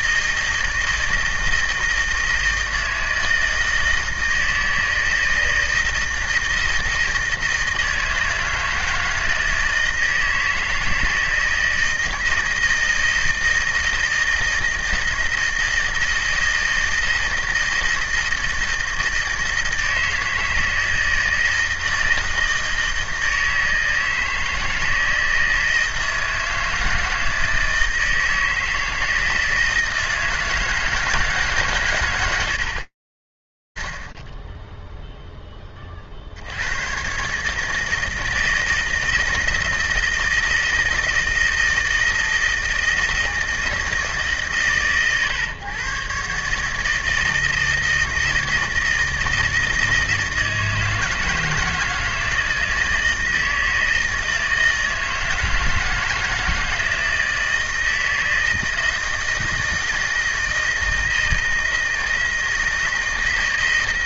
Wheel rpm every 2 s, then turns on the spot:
160, 160, 160, 160, 160, 160, 160, 160, 160, 160, 160, 160, 160, 160, 160, 160, 110, 50, 60, 160, 160, 160, 140, 140, 160, 160, 160, 160, 160, 160, 160, 160.
none